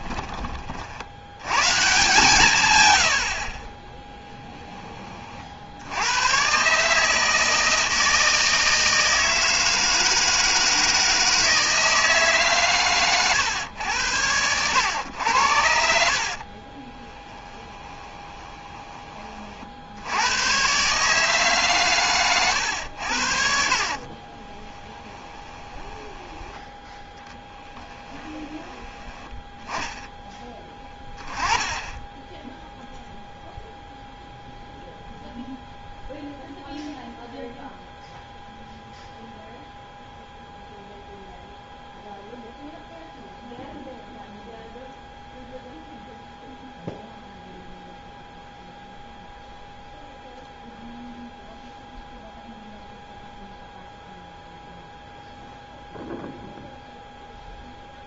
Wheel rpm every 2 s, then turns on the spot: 40, 130, 10, 130, 160, 160, 130, 100, 40, 20, 120, 100, 20, 10, 10, 20, 0, 0, 0, 0, 0, 0, 0, 0, 0, 0, 0, 0, 0.
16-20 24-26